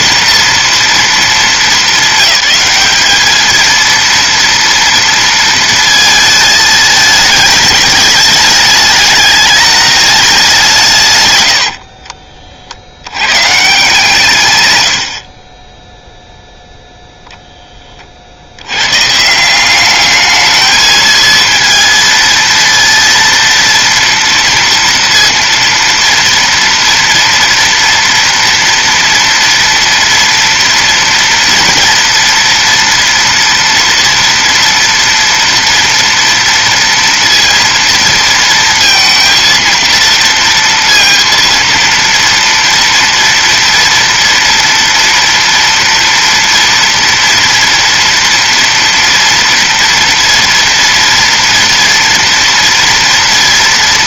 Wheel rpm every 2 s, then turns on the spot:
240, 210, 230, 220, 210, 170, 70, 100, 0, 110, 220, 230, 230, 230, 230, 230, 230, 240, 230, 230, 230, 230, 230, 230, 230, 230, 230.
none